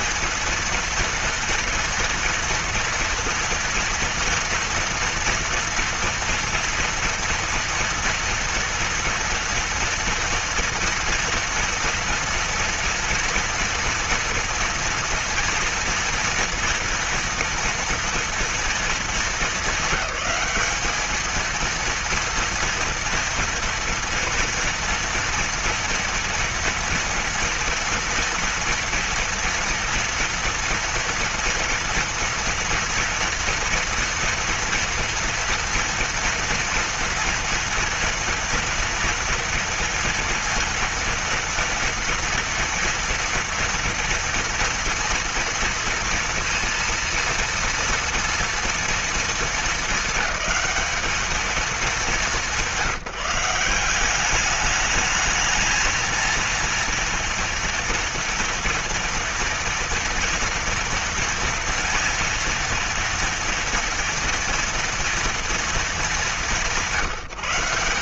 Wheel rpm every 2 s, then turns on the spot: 230, 230, 230, 230, 230, 230, 230, 240, 240, 230, 210, 230, 240, 240, 240, 230, 230, 230, 230, 230, 240, 230, 240, 230, 230, 200, 190, 200, 230, 230, 230, 230, 230, 180.
none